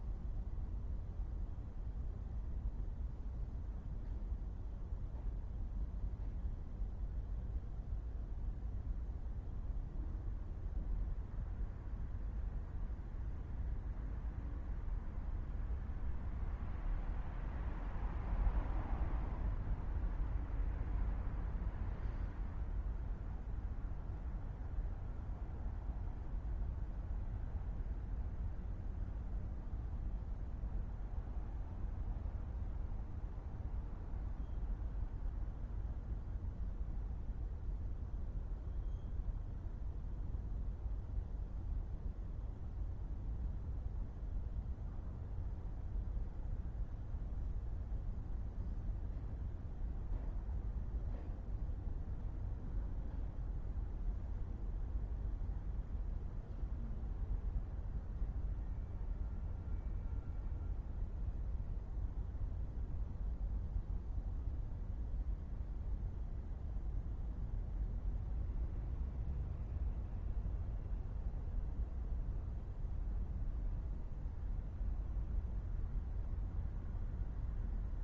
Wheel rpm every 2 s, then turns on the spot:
0, 0, 0, 0, 0, 0, 0, 0, 0, 0, 0, 0, 0, 0, 0, 0, 0, 0, 0, 0, 0, 0, 0, 0, 0, 0, 0, 0, 0, 0, 0, 0, 0, 0, 0, 0, 0, 0, 0.
none